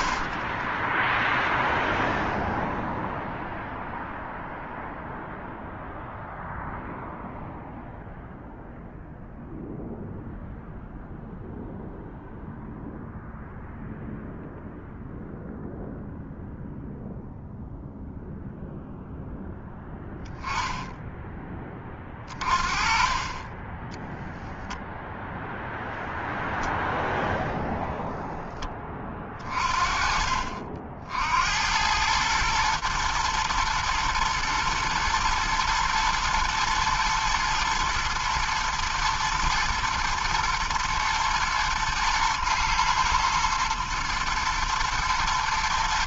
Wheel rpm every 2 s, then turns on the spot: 30, 0, 0, 0, 0, 0, 0, 0, 0, 0, 10, 30, 0, 0, 10, 40, 110, 110, 110, 120, 110, 110, 110.
0-2